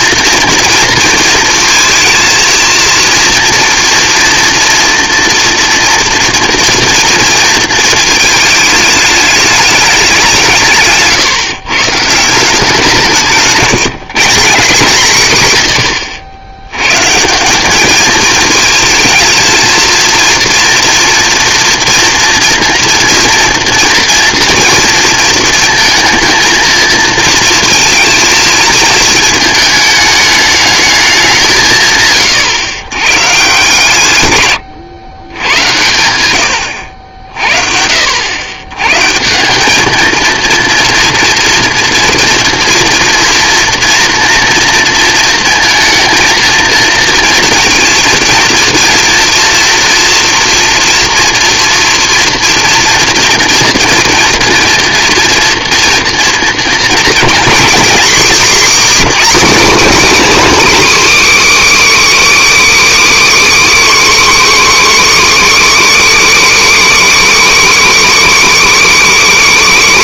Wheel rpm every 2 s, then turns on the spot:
230, 220, 230, 230, 210, 150, 170, 190, 110, 220, 230, 240, 230, 230, 220, 210, 130, 100, 70, 130, 230, 230, 230, 230, 230, 240, 240, 230, 230, 280, 310, 310, 300, 300, 290.
none